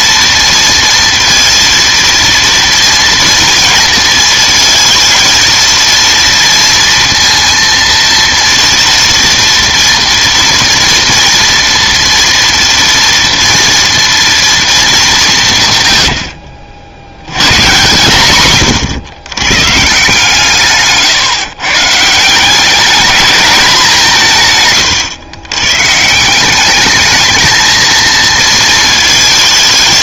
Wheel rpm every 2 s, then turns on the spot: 230, 230, 220, 230, 230, 230, 230, 220, 70, 120, 140, 190, 130, 200, 230.
18-22